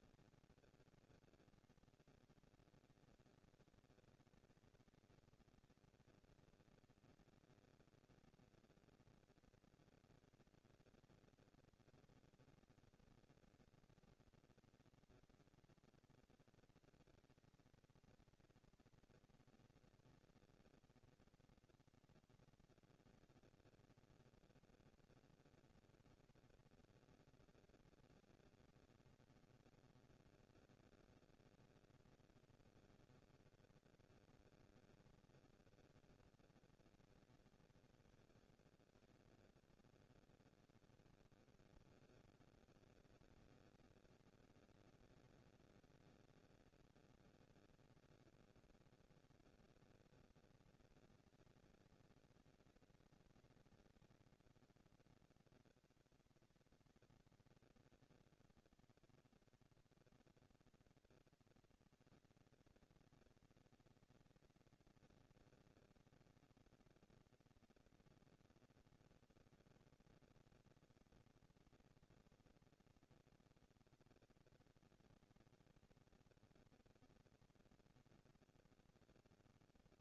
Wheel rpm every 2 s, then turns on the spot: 230, 230, 230, 230, 230, 240, 230, 230, 230, 230, 230, 230, 230, 230, 230, 230, 220, 210, 200, 130, 100, 210, 230, 230, 230, 230, 230, 230, 240, 220, 230, 230, 230, 230, 230, 230, 230, 230, 230, 230.
none